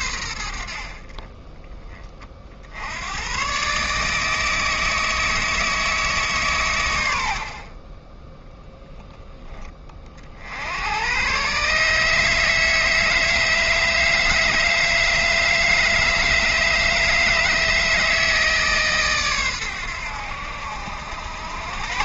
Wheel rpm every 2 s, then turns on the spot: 60, 70, 160, 120, 0, 80, 150, 160, 150, 150, 70.
none